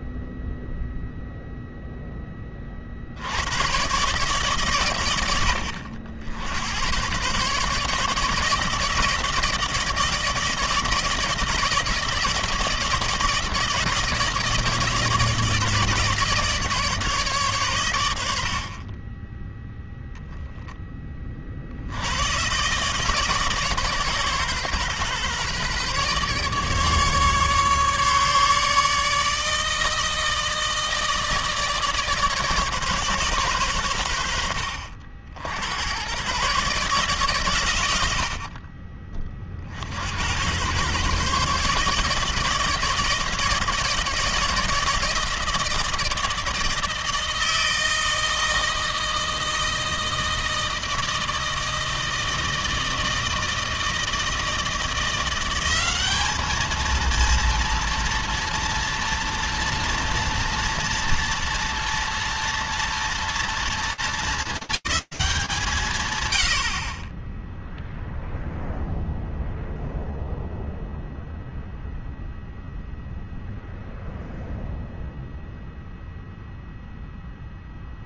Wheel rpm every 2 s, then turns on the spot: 0, 10, 130, 80, 150, 160, 160, 160, 150, 90, 0, 80, 140, 140, 150, 160, 160, 90, 100, 90, 70, 150, 160, 160, 160, 160, 160, 160, 200, 230, 230, 230, 210, 110, 0, 0, 0, 0, 0.
none